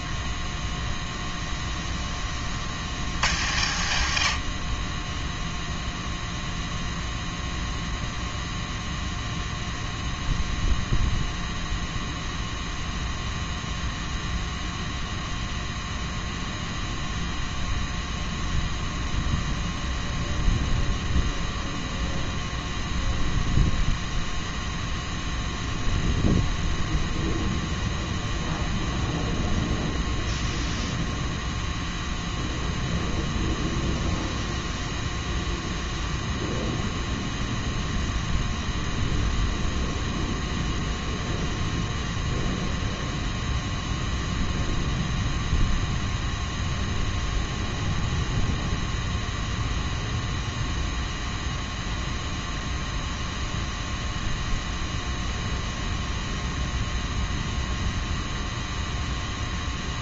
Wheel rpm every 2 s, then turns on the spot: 0, 60, 50, 0, 0, 0, 0, 0, 0, 0, 0, 0, 0, 0, 0, 0, 0, 0, 0, 0, 0, 0, 0, 0, 0, 0, 0, 0, 0, 0.
none